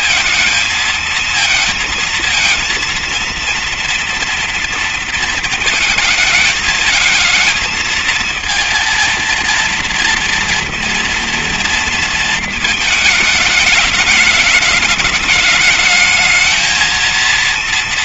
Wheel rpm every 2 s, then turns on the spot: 230, 230, 230, 220, 220, 230, 220, 210, 230.
none